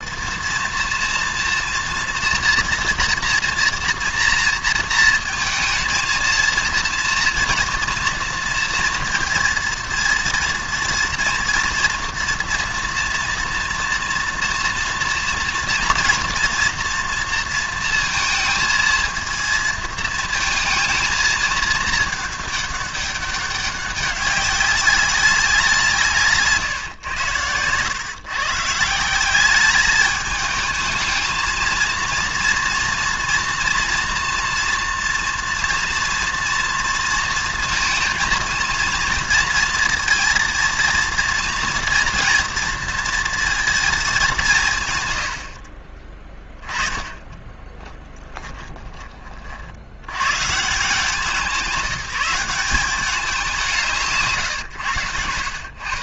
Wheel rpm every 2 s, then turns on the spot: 230, 240, 230, 230, 230, 230, 240, 230, 230, 230, 220, 210, 200, 130, 140, 220, 230, 240, 230, 230, 230, 230, 160, 20, 20, 160, 190, 120.
46-50